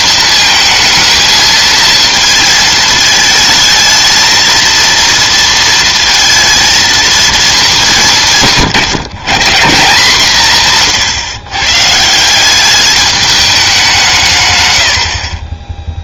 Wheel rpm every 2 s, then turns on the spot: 220, 220, 230, 230, 140, 140, 200, 100.
none